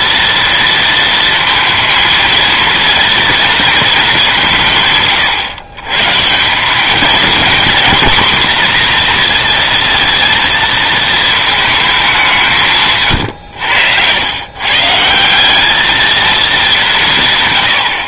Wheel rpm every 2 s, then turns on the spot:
230, 230, 130, 200, 240, 230, 160, 140, 190.
none